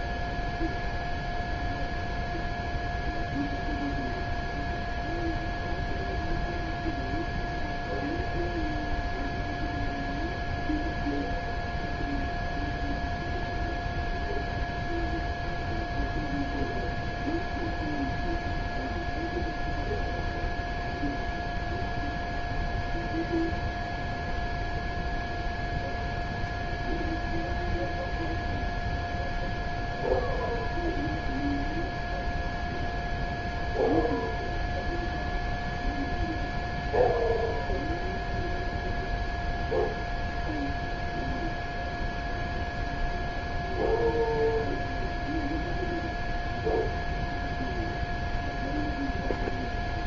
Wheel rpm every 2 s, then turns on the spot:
0, 0, 0, 0, 0, 0, 0, 0, 0, 0, 0, 0, 0, 0, 0, 0, 0, 0, 0, 0, 0, 0, 0, 0, 0.
none